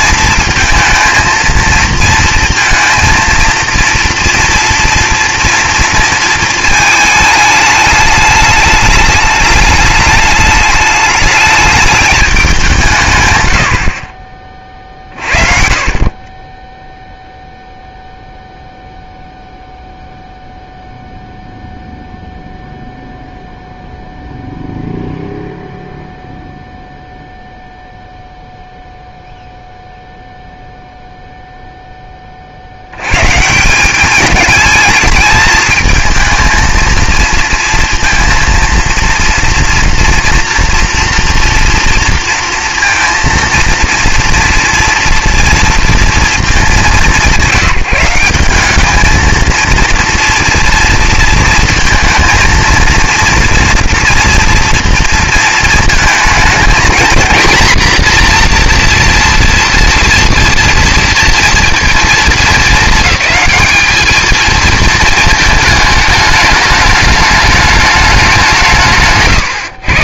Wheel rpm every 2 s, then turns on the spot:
230, 230, 230, 220, 210, 210, 180, 50, 10, 0, 0, 0, 0, 0, 0, 0, 70, 220, 220, 230, 230, 230, 240, 200, 210, 230, 230, 230, 230, 240, 230, 210, 230, 210, 160.
none